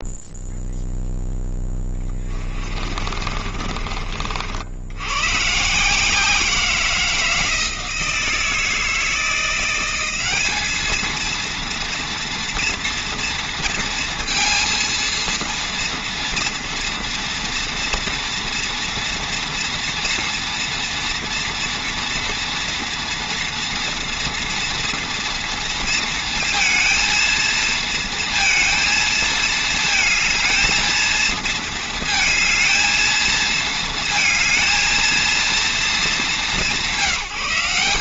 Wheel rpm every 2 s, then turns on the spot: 0, 30, 60, 170, 160, 200, 230, 230, 230, 230, 240, 240, 230, 230, 230, 220, 220, 230, 200.
2-4